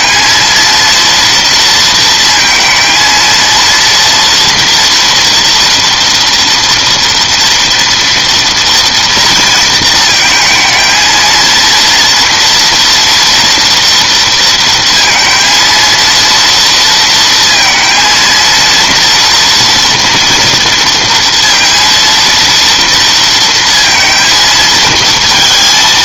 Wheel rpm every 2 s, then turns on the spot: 230, 230, 230, 230, 230, 240, 230, 230, 230, 240, 230, 230, 230.
none